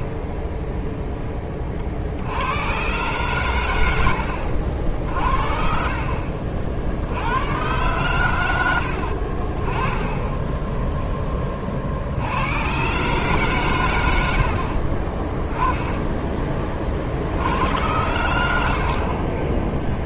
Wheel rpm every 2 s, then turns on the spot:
10, 110, 70, 60, 90, 10, 110, 60, 30, 70.
10-12